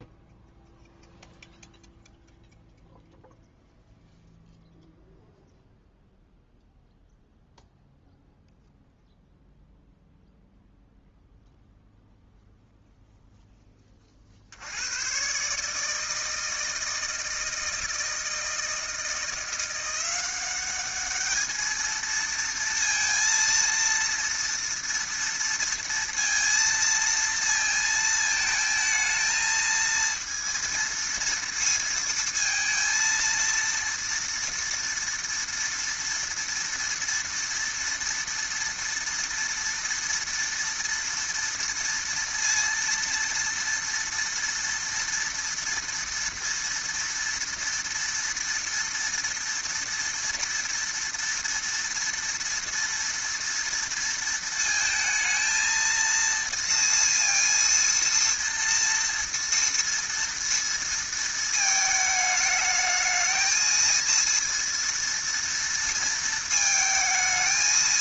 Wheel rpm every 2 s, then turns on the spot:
0, 0, 0, 0, 0, 0, 0, 60, 160, 160, 190, 230, 230, 230, 220, 230, 230, 230, 230, 230, 230, 230, 230, 230, 230, 230, 230, 230, 230, 230, 230, 210, 230, 220.
none